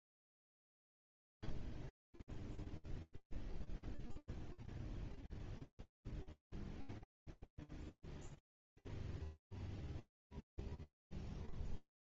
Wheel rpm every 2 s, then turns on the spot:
0, 0, 0, 0, 0, 0.
none